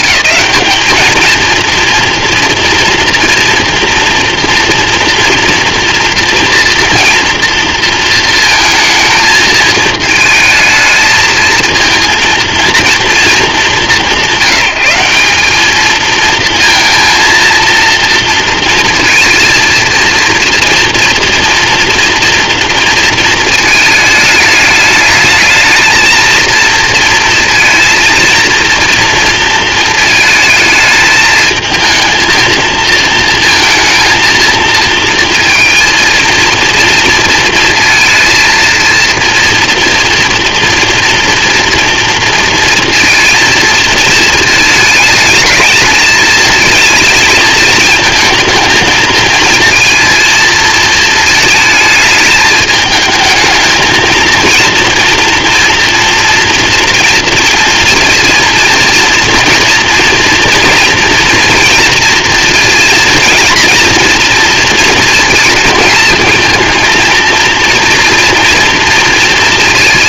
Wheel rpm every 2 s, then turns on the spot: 210, 230, 230, 240, 230, 220, 230, 180, 230, 230, 230, 230, 220, 230, 230, 220, 230, 230, 230, 230, 230, 230, 220, 220, 220, 220, 220, 230, 230, 230, 230, 230, 230, 230, 230.
none